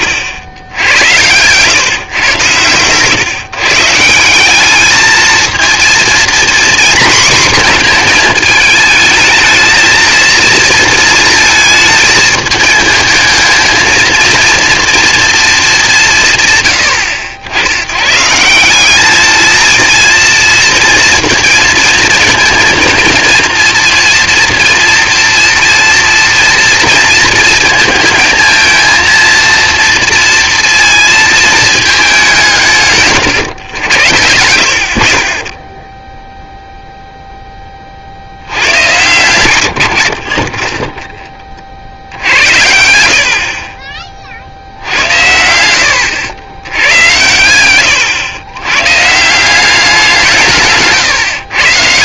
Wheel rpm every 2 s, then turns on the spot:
60, 110, 190, 240, 230, 230, 220, 230, 130, 160, 230, 230, 240, 230, 230, 230, 180, 70, 0, 70, 40, 70, 50, 90, 110, 160.
none